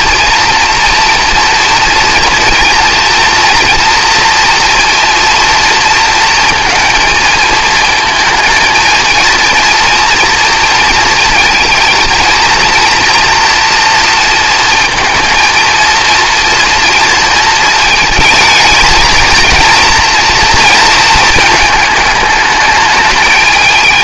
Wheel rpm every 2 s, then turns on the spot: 230, 230, 230, 230, 220, 230, 230, 230, 230, 220, 230, 210.
none